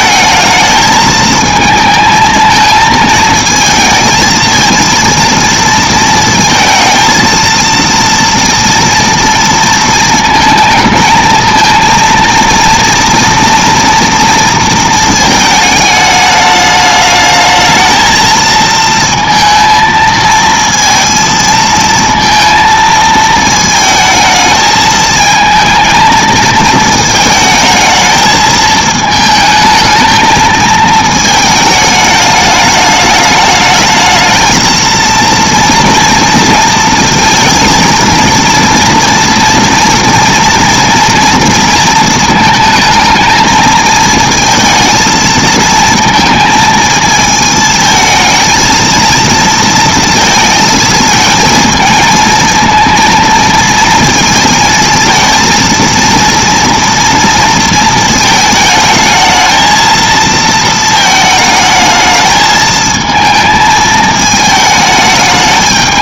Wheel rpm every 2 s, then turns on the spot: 220, 220, 220, 220, 230, 220, 230, 230, 210, 220, 230, 230, 220, 220, 220, 220, 210, 220, 230, 230, 230, 220, 220, 230, 220, 220, 230, 230, 230, 220, 230, 220, 220.
none